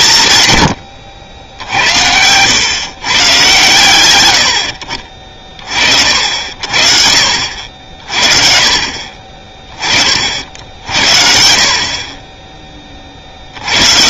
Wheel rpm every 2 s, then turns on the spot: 130, 120, 60, 50, 40, 60, 30.
none